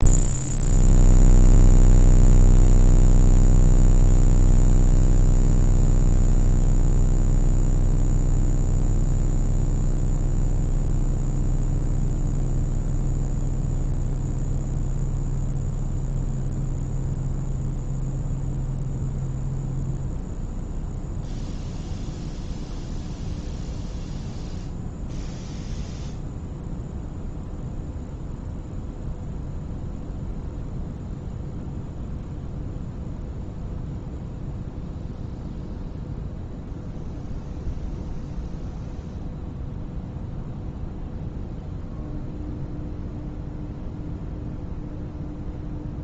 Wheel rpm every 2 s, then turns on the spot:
0, 0, 0, 0, 0, 0, 0, 0, 0, 0, 0, 0, 0, 0, 0, 0, 0, 0, 0, 0, 0, 0, 0.
none